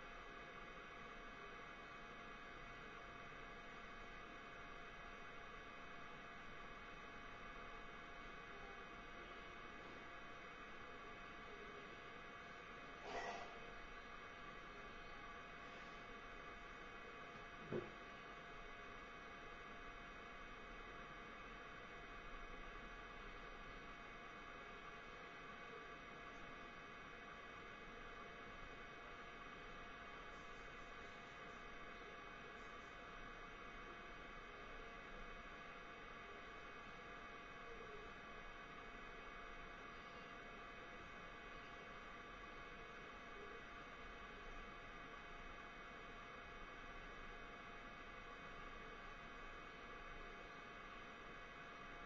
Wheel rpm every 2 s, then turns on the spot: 0, 0, 0, 0, 0, 0, 0, 0, 0, 0, 0, 0, 0, 0, 0, 0, 0, 0, 0, 0, 0, 0, 0, 0, 0, 0.
none